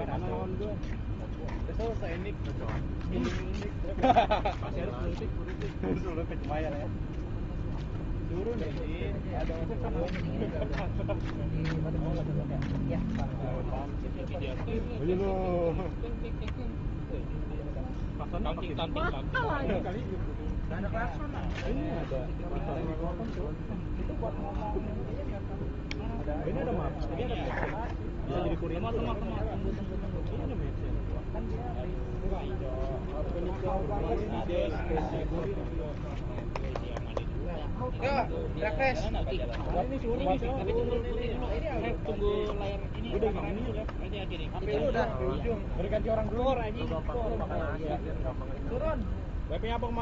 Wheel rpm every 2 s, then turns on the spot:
0, 0, 0, 0, 0, 0, 0, 0, 0, 0, 0, 0, 0, 0, 0, 0, 0, 0, 0, 0, 0, 0, 0, 0, 0.
none